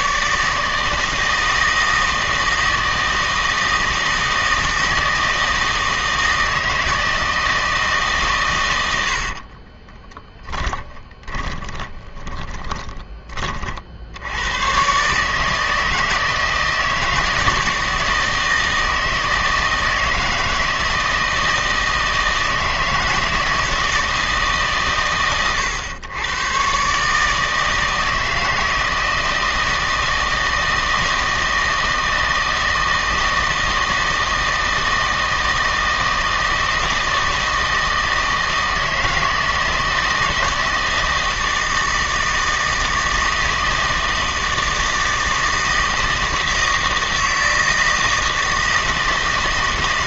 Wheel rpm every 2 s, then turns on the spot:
160, 160, 160, 160, 120, 20, 30, 100, 160, 160, 160, 160, 150, 120, 160, 160, 160, 160, 160, 160, 160, 160, 160, 160, 160.
10-14